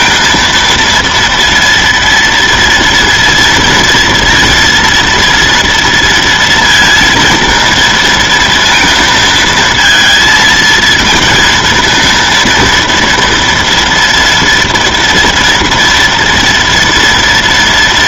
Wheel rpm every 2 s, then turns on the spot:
230, 230, 230, 230, 230, 220, 230, 230, 230.
none